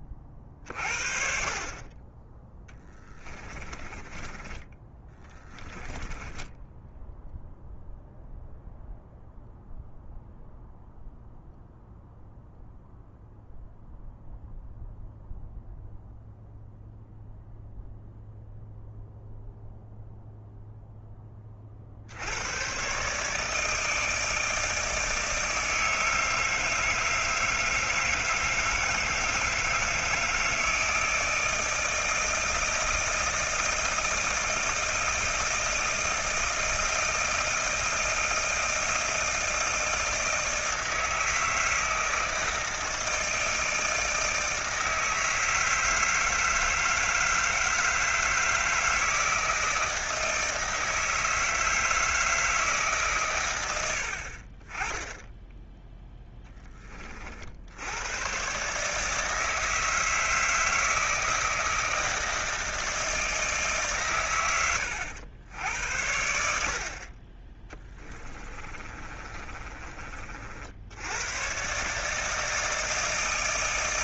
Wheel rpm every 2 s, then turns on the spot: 40, 20, 20, 10, 0, 0, 0, 0, 0, 0, 0, 100, 160, 160, 160, 160, 160, 160, 160, 160, 160, 160, 160, 160, 160, 160, 160, 40, 10, 130, 160, 160, 110, 70, 20, 40, 150.
4-8 68-70